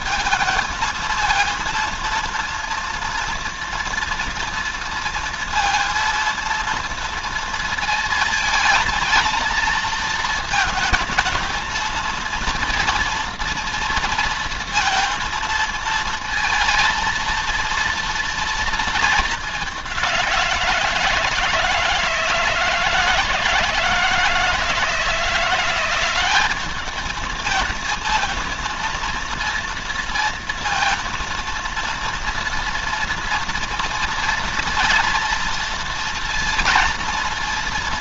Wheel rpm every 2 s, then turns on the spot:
230, 230, 230, 230, 230, 220, 230, 230, 230, 220, 170, 160, 160, 210, 230, 230, 230, 230, 230.
none